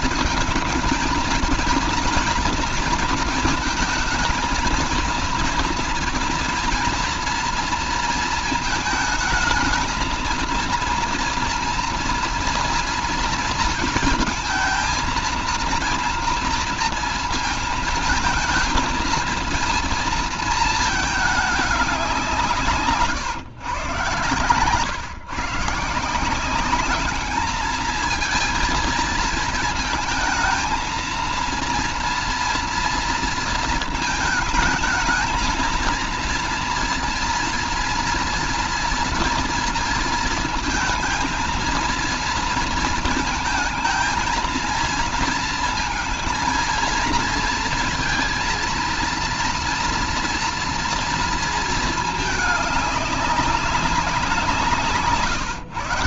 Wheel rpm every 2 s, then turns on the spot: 230, 230, 230, 240, 220, 230, 230, 230, 230, 230, 210, 150, 130, 210, 230, 230, 230, 220, 240, 230, 230, 230, 230, 230, 230, 230, 200, 150.
none